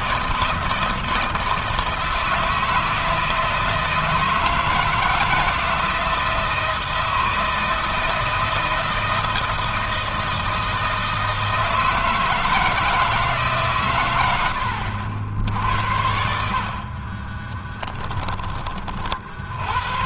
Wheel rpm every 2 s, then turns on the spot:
160, 160, 160, 160, 160, 160, 160, 70, 60, 40.
16-18